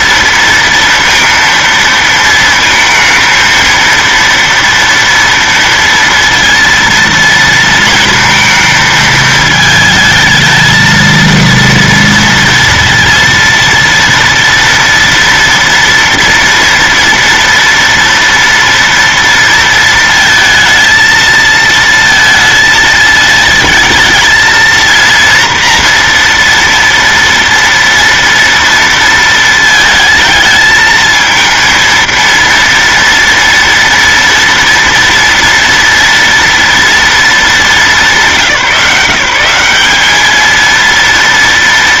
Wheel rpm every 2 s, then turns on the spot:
230, 230, 230, 230, 220, 230, 230, 230, 230, 230, 230, 230, 230, 230, 230, 220, 230, 230, 230, 170, 230.
none